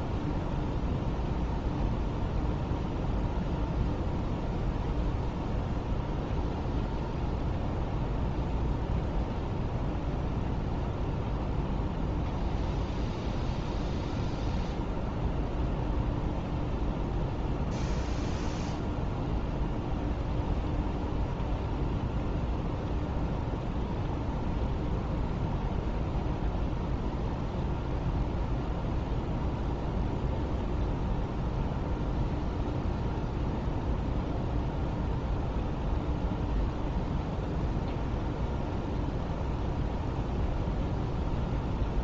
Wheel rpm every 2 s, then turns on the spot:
0, 0, 0, 0, 0, 0, 0, 0, 0, 0, 0, 0, 0, 0, 0, 0, 0, 0, 0, 0, 0.
none